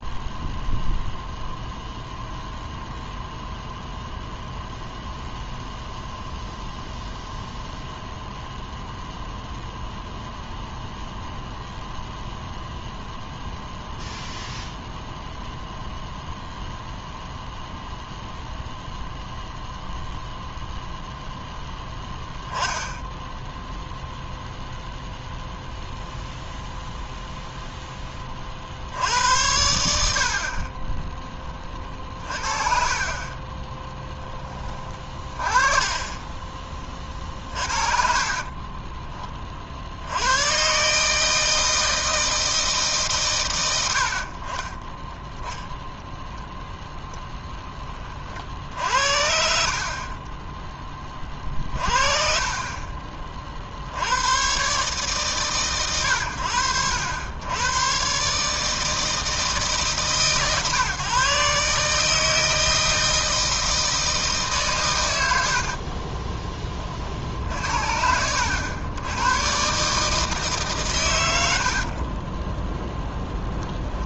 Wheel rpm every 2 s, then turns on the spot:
0, 0, 0, 0, 0, 0, 0, 0, 0, 0, 0, 10, 0, 0, 70, 20, 30, 20, 30, 20, 140, 150, 10, 0, 60, 20, 30, 140, 90, 160, 140, 160, 130, 40, 100, 120, 0.
32-34 44-46